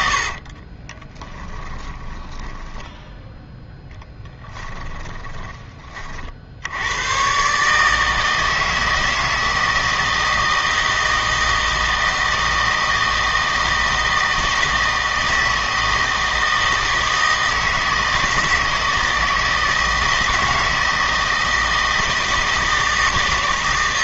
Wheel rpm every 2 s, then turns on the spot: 40, 20, 10, 70, 160, 160, 160, 160, 160, 160, 160, 160.
0-6